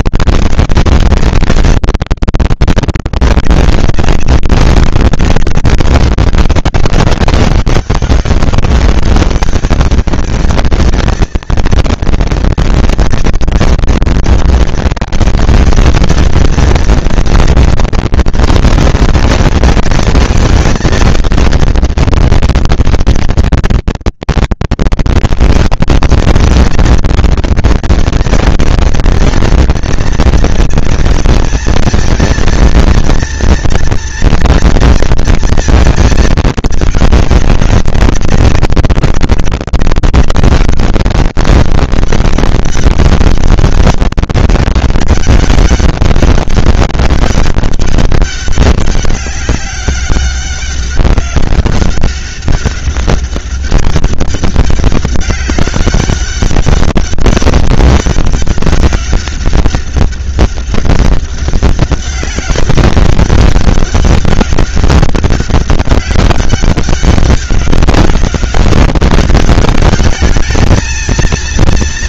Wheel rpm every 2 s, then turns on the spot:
230, 200, 190, 200, 200, 220, 230, 230, 230, 230, 230, 230, 230, 230, 230, 230, 230, 230, 210, 190, 190, 200, 190, 200, 200, 200, 200, 200, 200, 200, 200, 200, 200, 200, 200, 220.
none